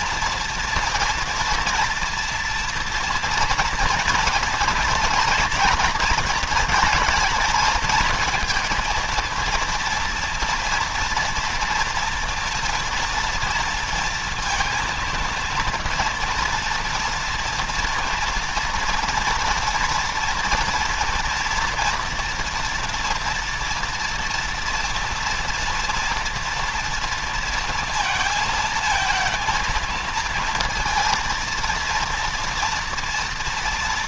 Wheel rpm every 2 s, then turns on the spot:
230, 230, 240, 230, 230, 230, 230, 230, 230, 230, 230, 230, 230, 230, 230, 230, 230.
none